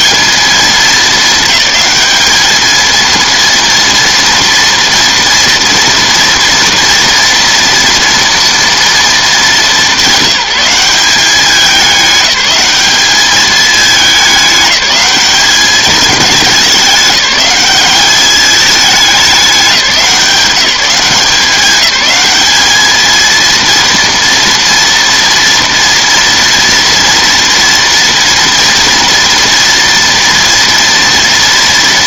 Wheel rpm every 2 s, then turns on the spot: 220, 220, 230, 230, 230, 190, 200, 200, 200, 210, 180, 220, 230, 230, 240, 230.
none